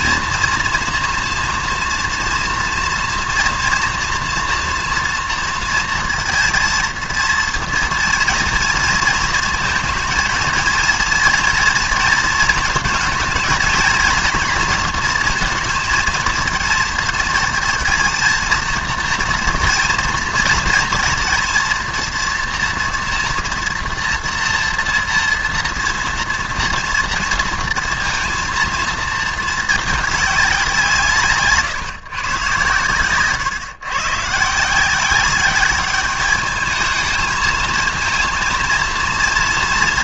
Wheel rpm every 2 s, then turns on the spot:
230, 230, 230, 230, 230, 230, 230, 230, 220, 230, 230, 240, 230, 230, 230, 170, 130, 180, 220, 230.
none